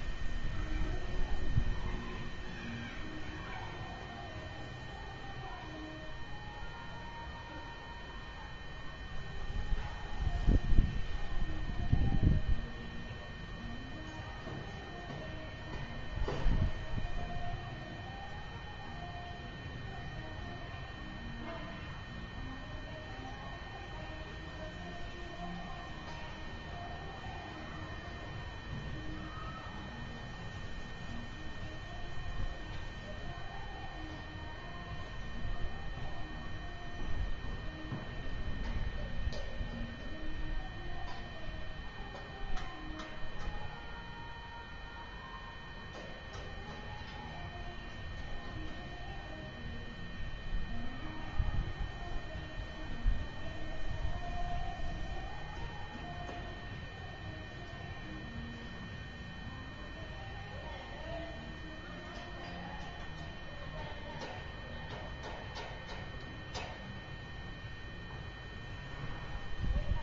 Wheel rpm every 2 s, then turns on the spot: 0, 0, 0, 0, 0, 0, 0, 0, 0, 0, 0, 0, 0, 0, 0, 0, 0, 0, 0, 0, 0, 0, 0, 0, 0, 0, 0, 0, 0, 0, 0, 0, 0, 0, 0.
none